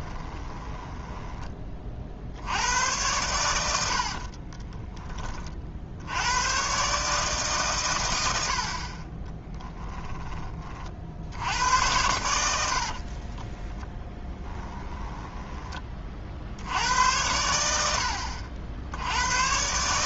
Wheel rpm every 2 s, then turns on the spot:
10, 80, 20, 120, 60, 40, 80, 10, 80, 70.
0-2 4-6 14-16